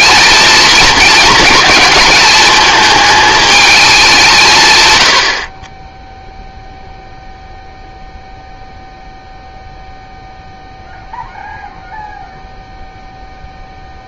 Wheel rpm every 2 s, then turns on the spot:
220, 220, 130, 0, 0, 0, 0.
none